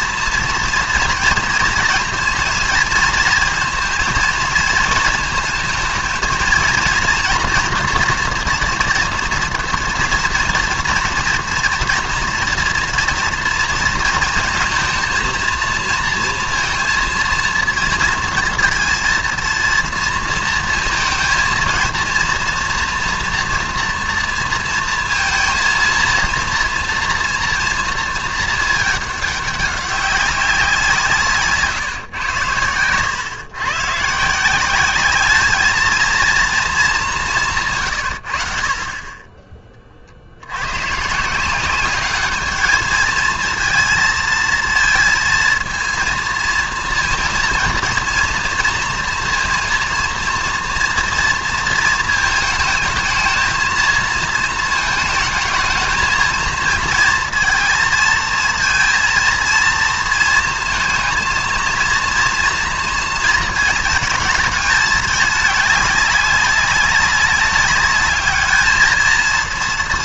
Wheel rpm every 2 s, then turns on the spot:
240, 230, 220, 230, 230, 230, 240, 220, 230, 230, 230, 240, 230, 230, 220, 180, 100, 180, 230, 50, 100, 220, 230, 230, 230, 240, 220, 220, 220, 230, 230, 230, 210, 200, 220.
32-34